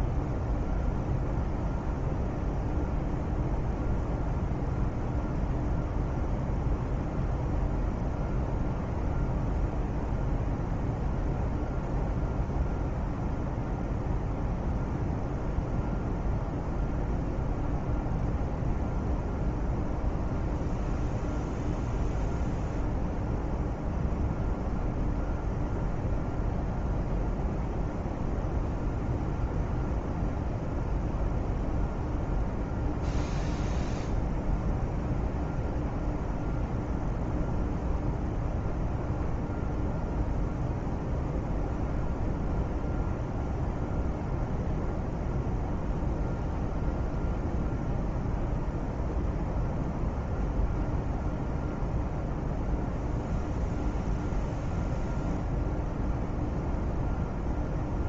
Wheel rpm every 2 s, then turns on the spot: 0, 0, 0, 0, 0, 0, 0, 0, 0, 0, 0, 0, 0, 0, 0, 0, 0, 0, 0, 0, 0, 0, 0, 0, 0, 0, 0, 0, 0.
none